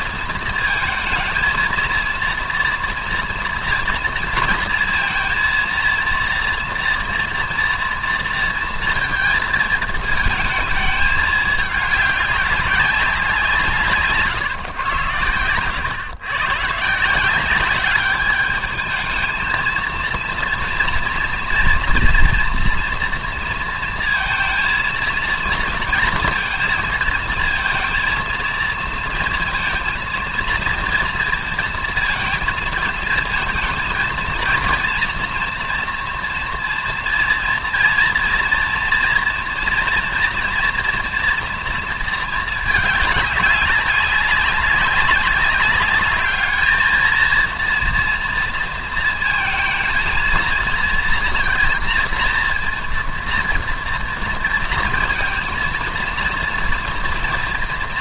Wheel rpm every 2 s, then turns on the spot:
230, 240, 230, 230, 230, 210, 190, 120, 160, 220, 240, 230, 230, 230, 230, 230, 230, 230, 240, 240, 240, 210, 200, 220, 230, 230, 230, 230, 230.
none